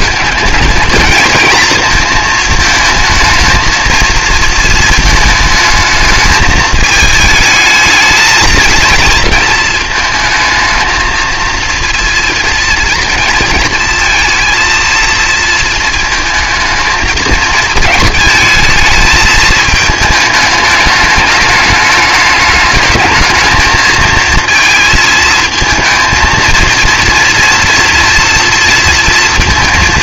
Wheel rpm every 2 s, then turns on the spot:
220, 220, 220, 220, 220, 220, 230, 230, 220, 220, 210, 220, 220, 230, 230.
none